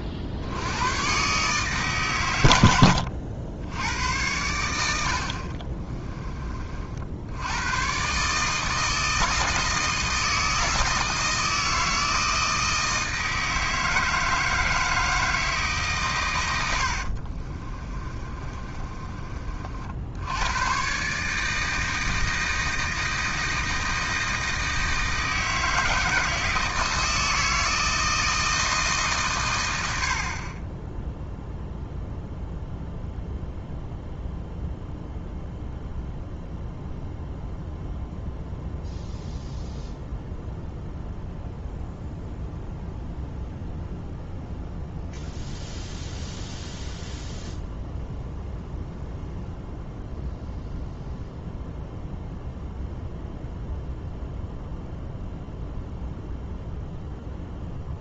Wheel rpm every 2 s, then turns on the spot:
110, 80, 80, 60, 160, 160, 160, 160, 80, 30, 130, 160, 160, 160, 150, 10, 0, 0, 0, 0, 0, 0, 0, 0, 0, 0, 0, 0, 0.
2-4 16-20